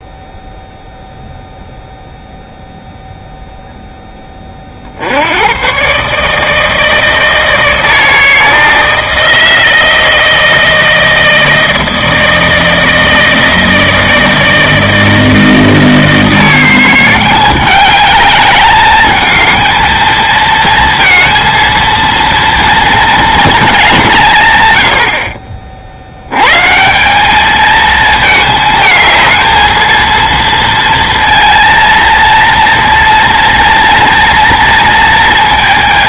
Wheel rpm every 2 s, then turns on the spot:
0, 0, 40, 160, 160, 160, 160, 160, 170, 210, 230, 230, 120, 130, 220, 230, 230, 230.
none